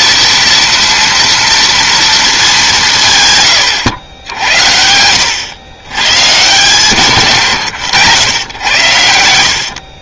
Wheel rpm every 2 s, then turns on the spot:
230, 180, 80, 130, 100.
none